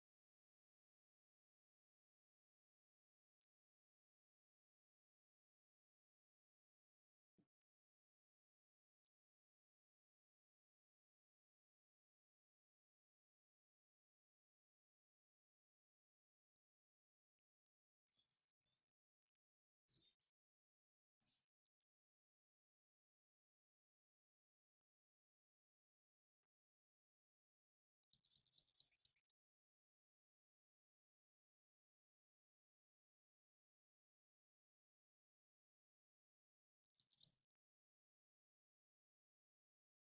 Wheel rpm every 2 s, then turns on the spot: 0, 0, 0, 0, 0, 0, 0, 0, 0, 0, 0, 0, 0, 0, 0, 0, 0, 0, 0, 0.
none